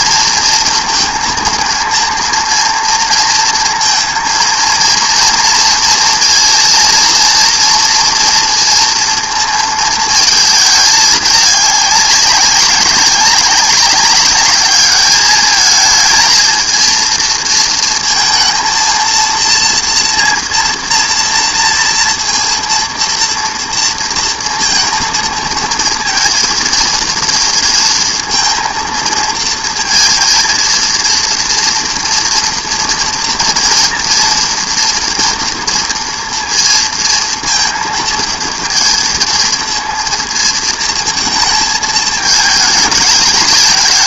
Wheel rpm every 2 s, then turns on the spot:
230, 230, 230, 230, 230, 220, 200, 200, 220, 230, 230, 230, 230, 230, 230, 230, 230, 230, 230, 230, 230, 220.
none